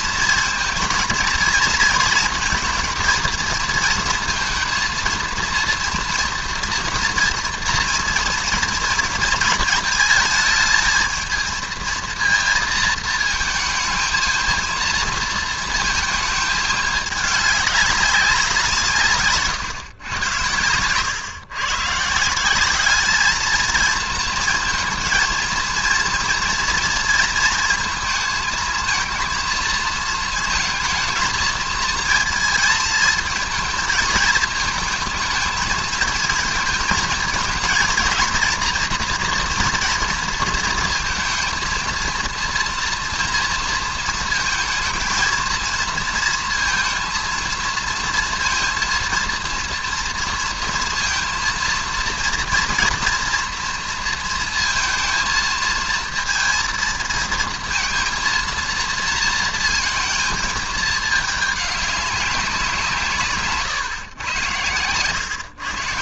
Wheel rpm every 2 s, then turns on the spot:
230, 230, 230, 230, 230, 220, 220, 220, 220, 180, 100, 190, 230, 230, 220, 230, 220, 220, 230, 230, 220, 230, 230, 230, 230, 230, 230, 230, 230, 230, 220, 180, 110.
none